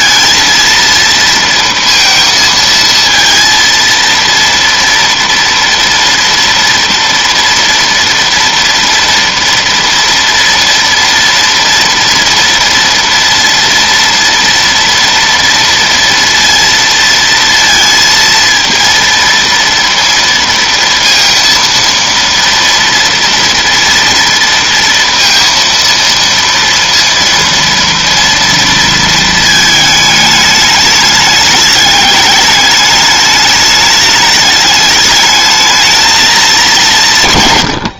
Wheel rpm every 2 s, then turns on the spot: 230, 230, 230, 230, 230, 230, 230, 230, 230, 230, 230, 230, 230, 230, 230, 210, 210, 210, 180.
none